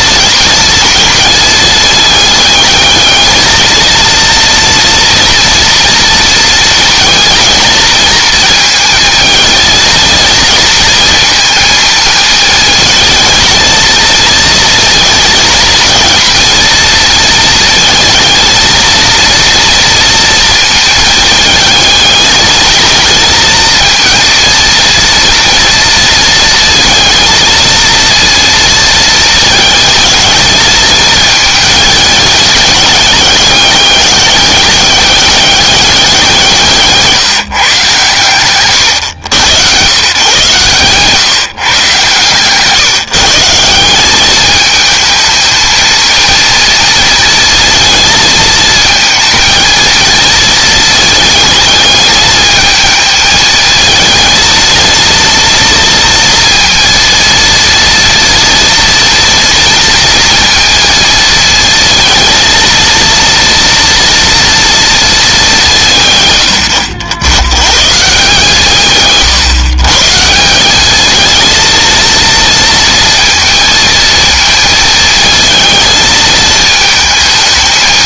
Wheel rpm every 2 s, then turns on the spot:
220, 210, 230, 220, 230, 230, 220, 230, 230, 230, 220, 220, 230, 220, 230, 220, 210, 200, 160, 120, 140, 150, 220, 230, 220, 220, 220, 230, 230, 230, 230, 230, 230, 90, 150, 200, 230, 220, 220.
none